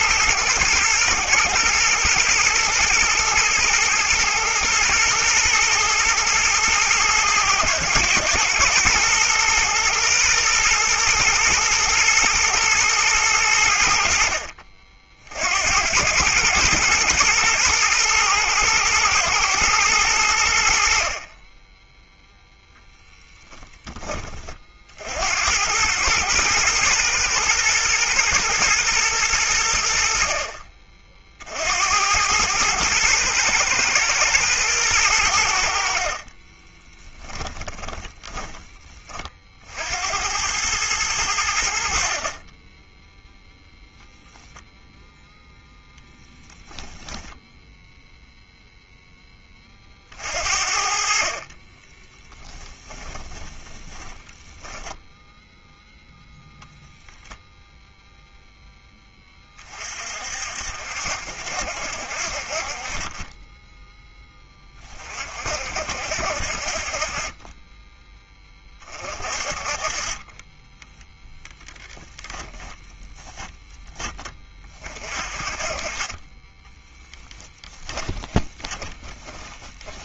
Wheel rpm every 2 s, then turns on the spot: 110, 120, 120, 110, 120, 120, 110, 50, 110, 110, 70, 0, 50, 110, 110, 50, 110, 110, 20, 30, 100, 10, 0, 0, 0, 50, 10, 10, 0, 10, 60, 40, 20, 50, 30, 10, 10, 30, 10, 10.
36-38 50-54 76-80